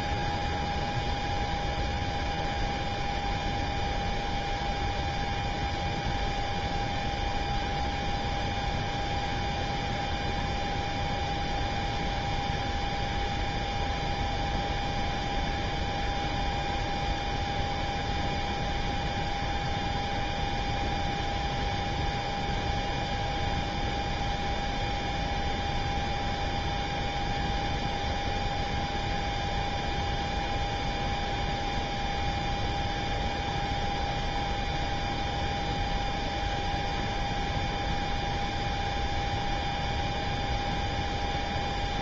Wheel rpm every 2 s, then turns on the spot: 0, 0, 0, 0, 0, 0, 0, 0, 0, 0, 0, 0, 0, 0, 0, 0, 0, 0, 0, 0, 0.
none